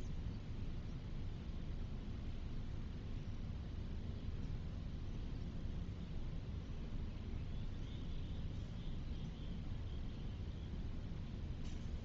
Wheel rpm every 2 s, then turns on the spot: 0, 0, 0, 0, 0, 0.
none